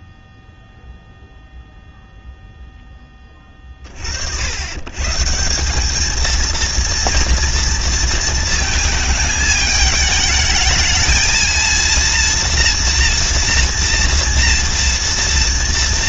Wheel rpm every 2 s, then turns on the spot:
0, 0, 80, 230, 230, 210, 240, 230.
none